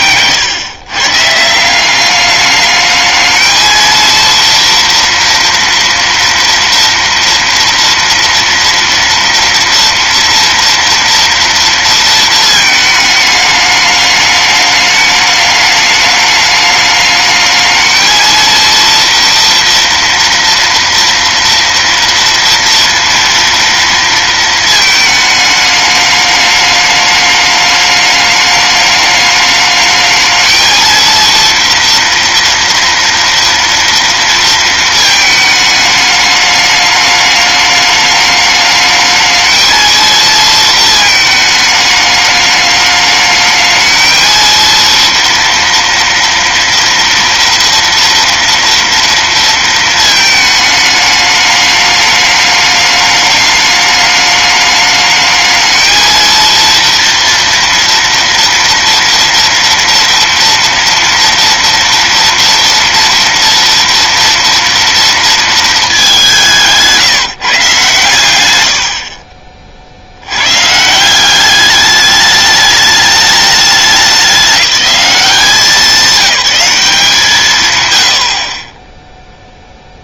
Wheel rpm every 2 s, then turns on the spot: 130, 210, 230, 240, 230, 230, 220, 210, 210, 230, 230, 230, 220, 210, 210, 220, 230, 230, 210, 210, 230, 210, 230, 230, 240, 220, 210, 210, 230, 230, 230, 230, 230, 170, 100, 120, 210, 200, 190, 40.
none